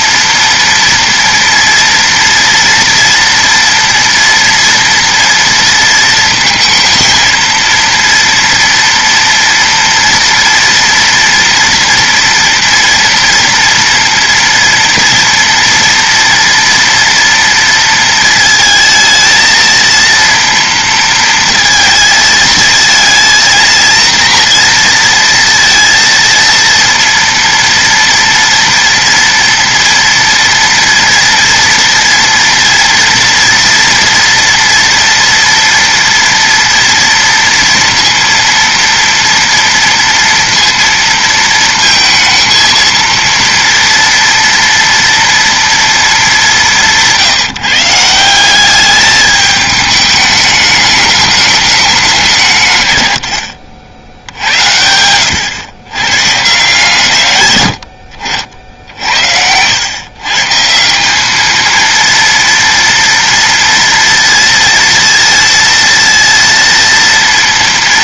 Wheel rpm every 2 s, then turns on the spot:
230, 230, 230, 230, 230, 230, 240, 240, 230, 220, 230, 220, 230, 230, 230, 230, 230, 230, 230, 230, 230, 230, 230, 170, 200, 210, 140, 80, 150, 60, 160, 230, 230, 230.
none